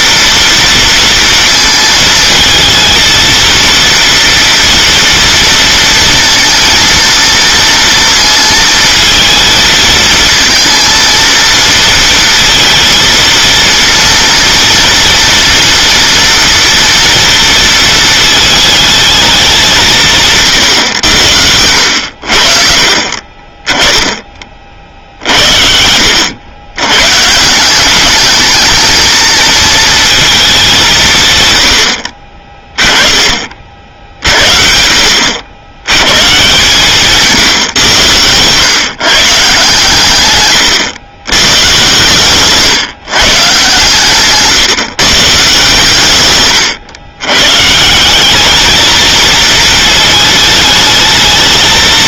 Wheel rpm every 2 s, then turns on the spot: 230, 220, 230, 230, 220, 230, 230, 230, 230, 220, 140, 50, 40, 100, 220, 190, 20, 60, 140, 120, 120, 140, 150, 120, 210, 210.
40-42